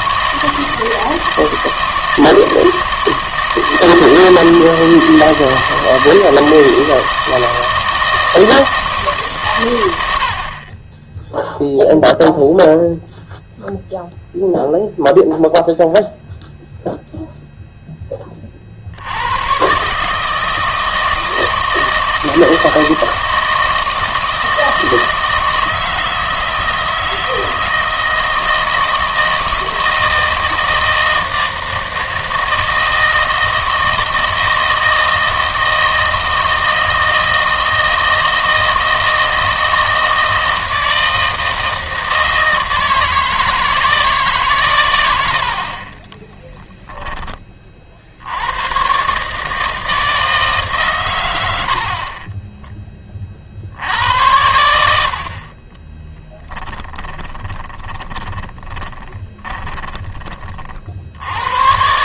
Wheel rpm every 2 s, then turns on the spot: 160, 160, 160, 160, 160, 30, 0, 0, 0, 50, 160, 160, 160, 160, 160, 160, 160, 160, 160, 160, 160, 160, 130, 10, 100, 150, 10, 80, 10, 20, 40.
46-48 56-60